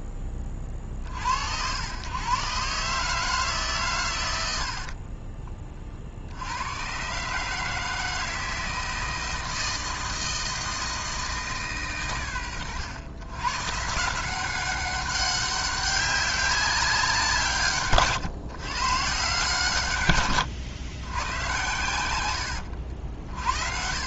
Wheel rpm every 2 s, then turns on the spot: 50, 150, 60, 120, 160, 160, 100, 190, 190, 130, 110, 80.
4-6 22-24